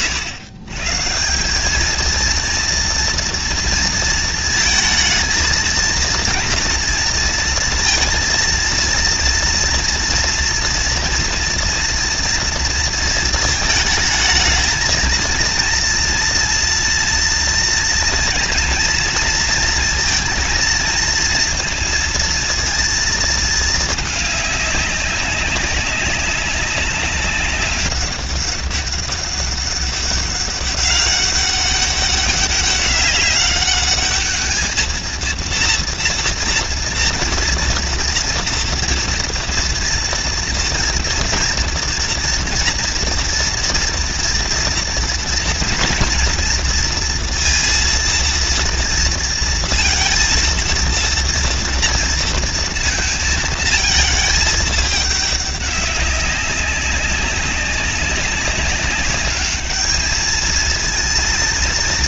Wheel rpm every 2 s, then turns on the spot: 110, 230, 230, 230, 230, 240, 230, 230, 230, 230, 230, 230, 200, 200, 200, 200, 200, 220, 230, 230, 240, 230, 230, 230, 230, 230, 230, 220, 200, 200, 220.
none